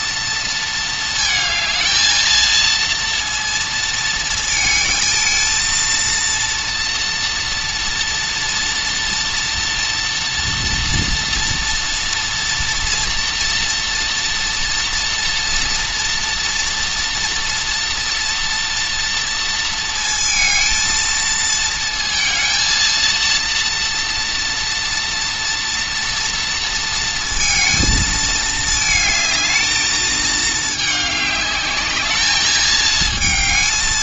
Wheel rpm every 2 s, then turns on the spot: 220, 230, 220, 230, 240, 240, 230, 230, 230, 240, 230, 230, 230, 230, 220, 210, 220.
none